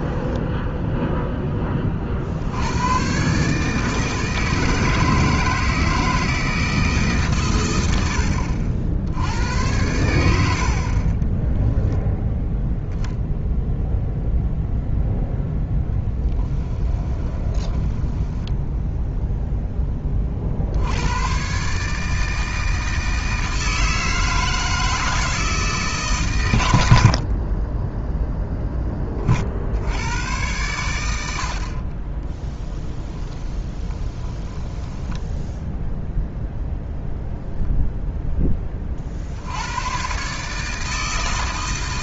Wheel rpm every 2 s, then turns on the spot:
0, 100, 160, 150, 70, 40, 0, 0, 10, 0, 80, 160, 160, 80, 10, 90, 10, 10, 0, 30, 160.
10-12 16-18 32-36